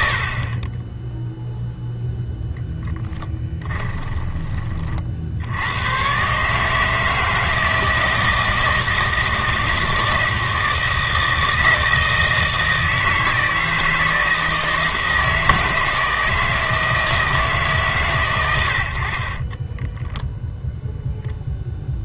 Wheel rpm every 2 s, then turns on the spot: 20, 0, 30, 150, 160, 160, 160, 160, 160, 90, 0.
none